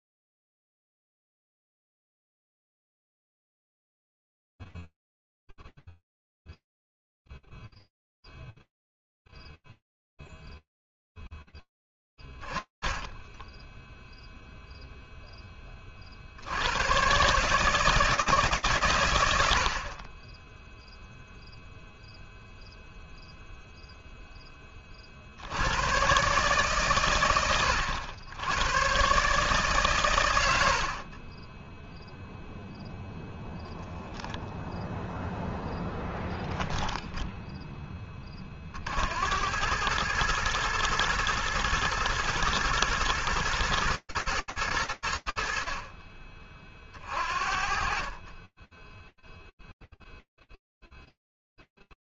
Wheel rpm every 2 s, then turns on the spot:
0, 0, 0, 0, 0, 0, 0, 10, 140, 80, 0, 0, 100, 100, 120, 0, 10, 10, 50, 110, 110, 100, 30, 20, 0, 0.
none